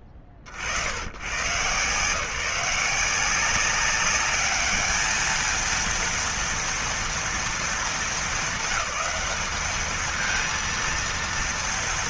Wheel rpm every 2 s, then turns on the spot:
40, 160, 210, 230, 210, 230.
none